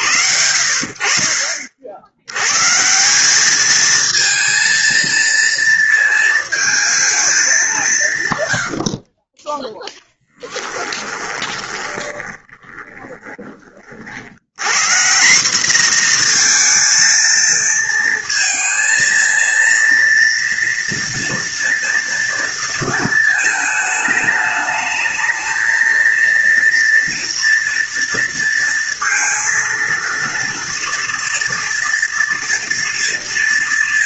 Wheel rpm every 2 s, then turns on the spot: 70, 160, 230, 220, 50, 10, 20, 160, 230, 230, 230, 220, 220, 240, 230, 230, 230.
10-14